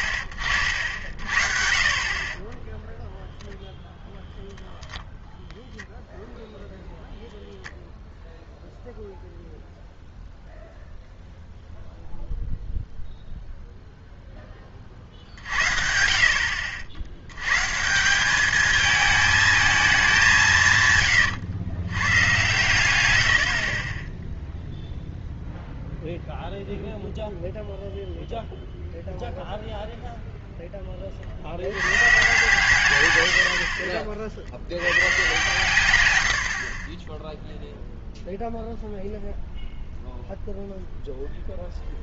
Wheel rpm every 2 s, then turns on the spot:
80, 20, 0, 0, 0, 0, 0, 30, 70, 210, 160, 120, 0, 0, 0, 10, 130, 80, 60, 0, 0.
2-4